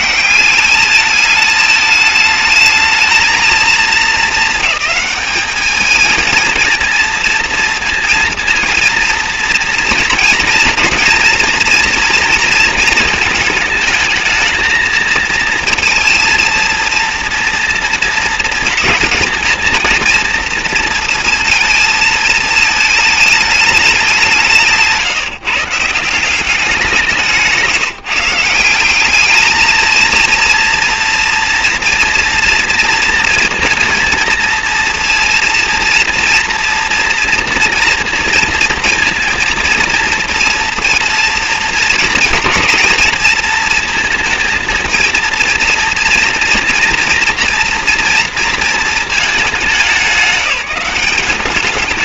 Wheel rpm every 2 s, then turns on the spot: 210, 210, 220, 220, 230, 230, 230, 220, 230, 230, 230, 220, 160, 180, 180, 230, 230, 230, 240, 230, 230, 230, 230, 230, 230, 200.
none